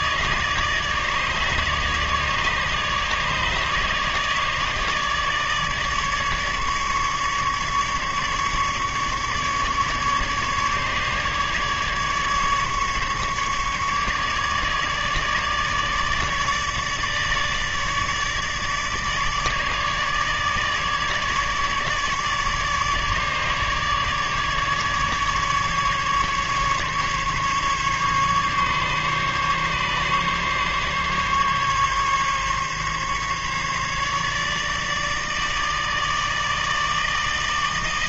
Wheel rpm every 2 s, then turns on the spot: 150, 150, 150, 150, 150, 150, 150, 150, 150, 150, 150, 150, 150, 150, 140, 140, 140, 150, 160.
none